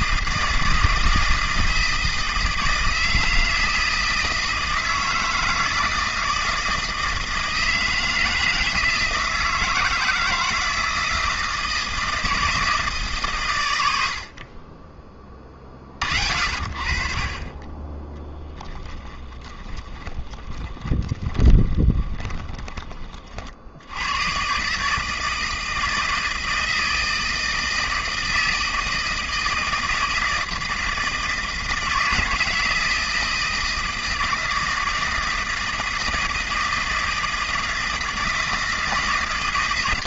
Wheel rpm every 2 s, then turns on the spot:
160, 160, 160, 160, 160, 160, 160, 30, 40, 10, 20, 20, 140, 160, 160, 160, 160, 160, 160, 160.
18-22